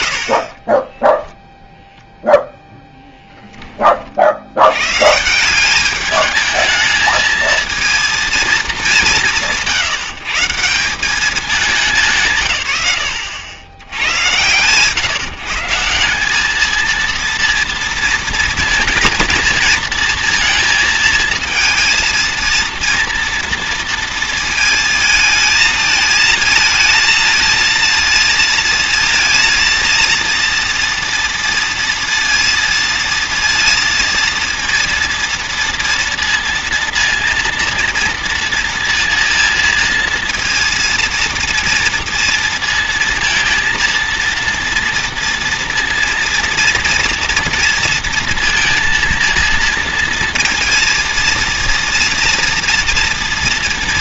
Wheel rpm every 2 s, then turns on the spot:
10, 10, 100, 220, 210, 160, 140, 120, 220, 230, 220, 230, 220, 230, 230, 230, 230, 230, 230, 230, 230, 230, 230, 230, 230, 230, 230.
0-2